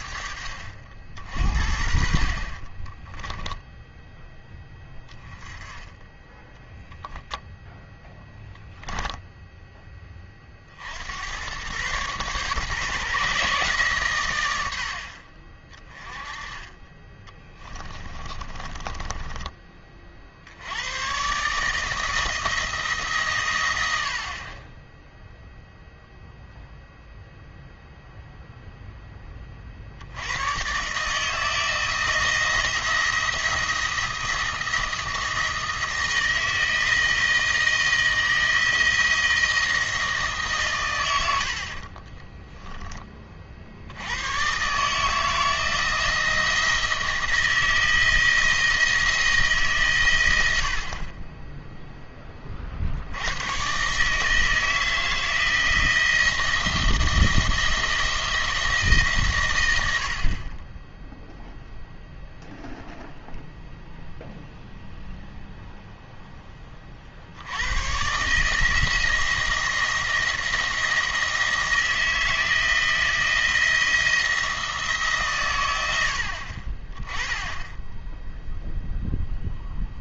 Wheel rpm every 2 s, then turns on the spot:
60, 30, 10, 10, 10, 50, 140, 80, 20, 20, 80, 160, 20, 0, 0, 130, 160, 160, 160, 160, 140, 10, 130, 170, 160, 60, 40, 160, 170, 160, 20, 0, 0, 20, 160, 170, 160, 160, 40, 0.
2-4 18-20